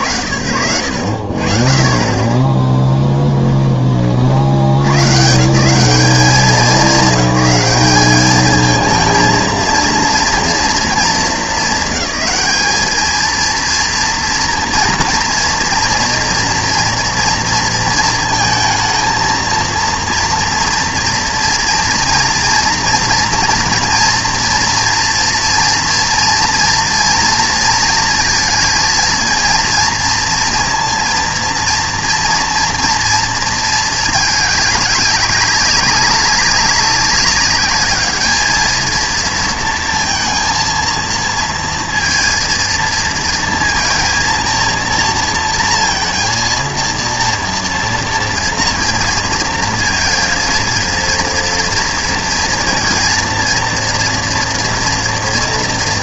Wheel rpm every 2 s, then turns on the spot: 90, 10, 130, 190, 220, 230, 220, 240, 230, 230, 230, 230, 230, 230, 230, 230, 230, 200, 200, 220, 230, 230, 230, 230, 230, 230, 230, 230.
2-4